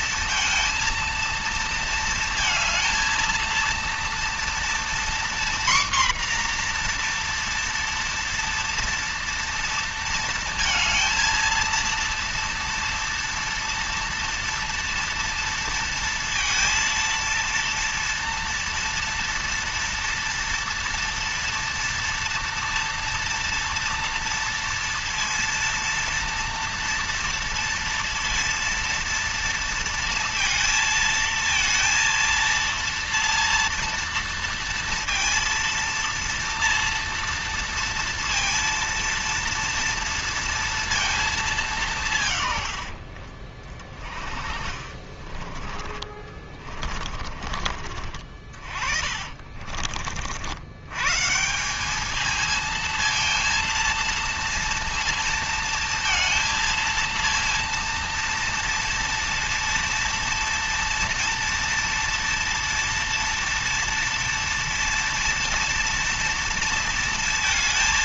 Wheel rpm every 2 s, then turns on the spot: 230, 230, 240, 240, 230, 230, 240, 230, 230, 230, 230, 230, 230, 230, 230, 230, 230, 230, 230, 230, 230, 100, 40, 30, 50, 100, 220, 230, 230, 230, 230, 230, 230, 230.
44-50